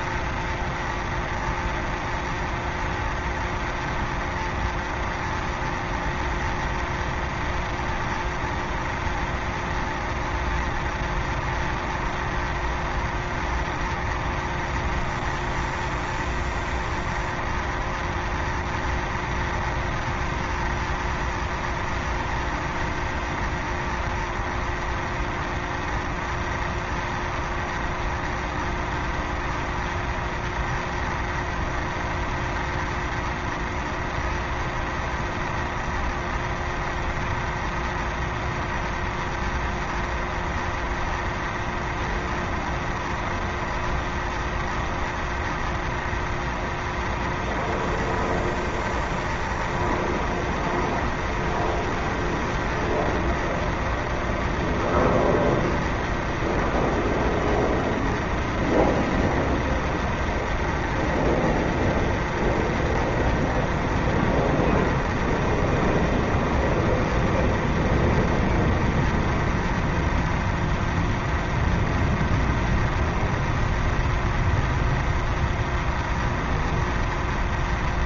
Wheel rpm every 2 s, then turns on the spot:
0, 0, 0, 0, 0, 0, 0, 0, 0, 0, 0, 0, 0, 0, 0, 0, 0, 0, 0, 0, 0, 0, 0, 0, 0, 0, 0, 0, 0, 0, 0, 0, 0, 0, 0, 0, 0, 0, 0.
none